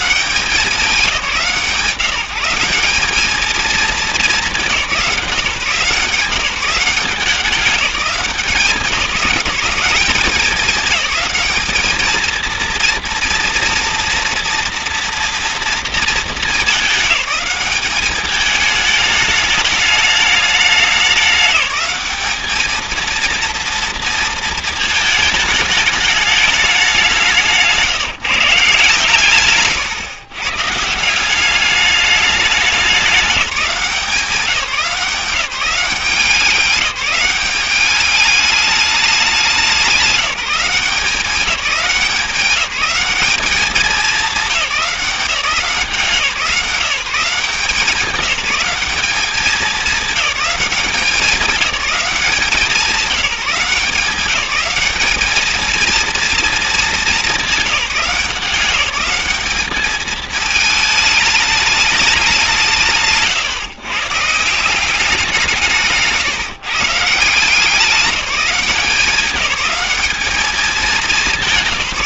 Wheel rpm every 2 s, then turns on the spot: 200, 180, 200, 190, 190, 200, 220, 240, 200, 210, 210, 220, 220, 200, 160, 150, 200, 180, 190, 210, 180, 180, 190, 180, 210, 200, 190, 200, 220, 190, 220, 170, 170, 140, 180, 210.
none